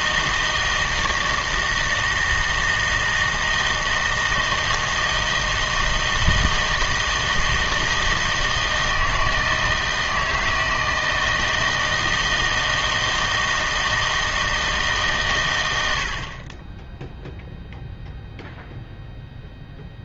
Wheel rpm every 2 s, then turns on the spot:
160, 160, 160, 160, 160, 160, 160, 160, 20, 0.
none